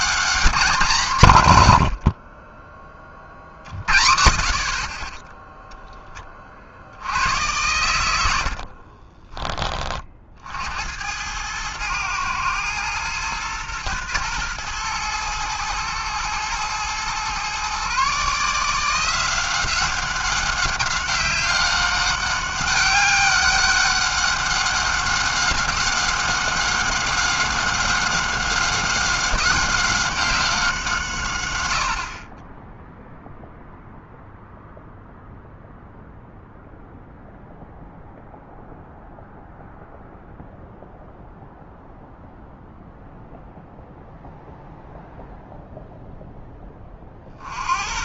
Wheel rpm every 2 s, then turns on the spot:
200, 70, 40, 20, 100, 40, 110, 120, 110, 140, 190, 190, 200, 190, 190, 190, 70, 0, 0, 0, 0, 0, 0, 0.
none